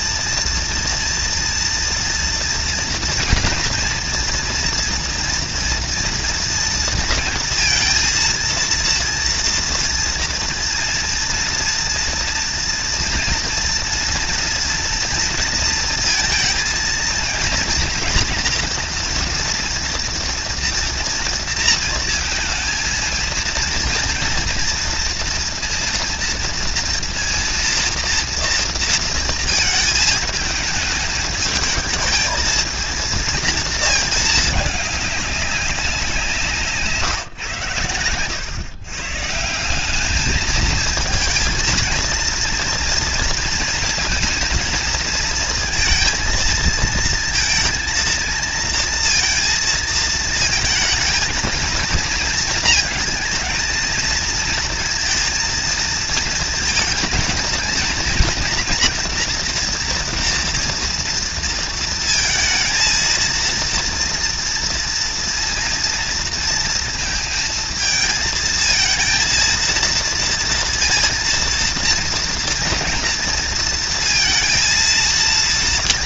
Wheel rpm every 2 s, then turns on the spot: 240, 230, 230, 230, 230, 230, 230, 230, 230, 240, 230, 230, 230, 230, 230, 220, 220, 210, 160, 130, 220, 230, 230, 230, 230, 220, 230, 230, 230, 240, 230, 230, 230, 230, 230, 230, 230, 230.
none